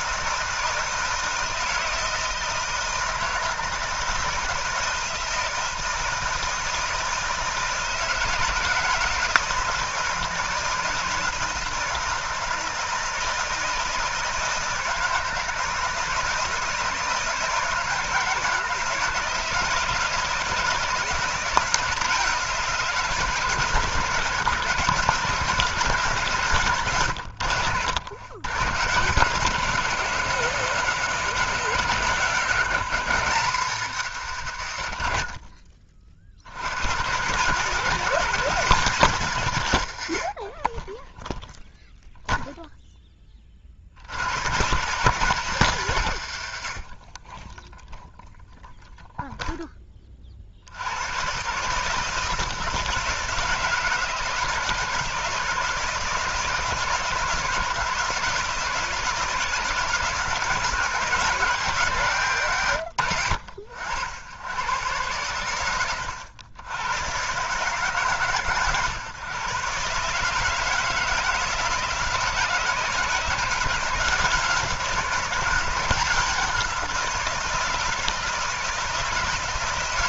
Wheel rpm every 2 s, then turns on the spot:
160, 160, 160, 160, 160, 170, 160, 160, 160, 150, 160, 170, 140, 140, 120, 160, 160, 120, 80, 160, 20, 0, 130, 80, 0, 60, 160, 160, 160, 160, 160, 100, 100, 100, 140, 160, 160, 170, 180, 160.
none